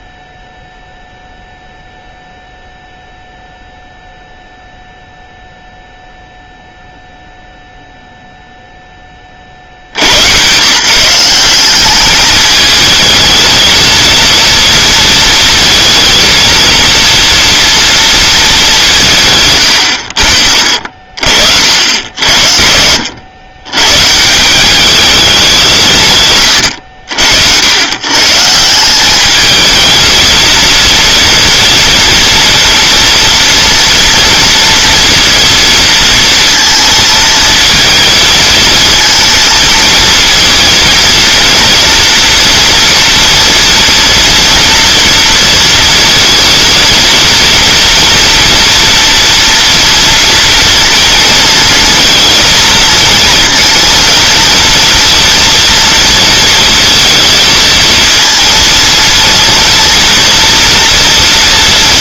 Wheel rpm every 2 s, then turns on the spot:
0, 0, 0, 0, 20, 160, 220, 230, 230, 180, 50, 80, 200, 80, 180, 230, 230, 230, 230, 220, 230, 230, 230, 230, 230, 230, 220, 230, 230, 230, 230.
none